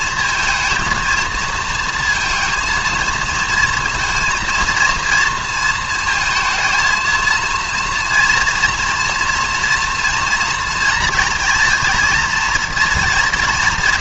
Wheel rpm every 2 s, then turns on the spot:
230, 230, 230, 220, 230, 230, 230.
none